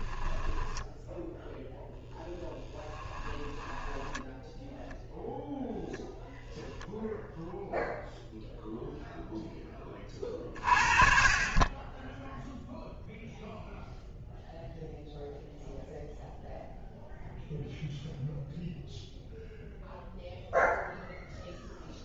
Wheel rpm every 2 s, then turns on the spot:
10, 10, 0, 0, 0, 40, 0, 0, 0, 0, 0.
2-4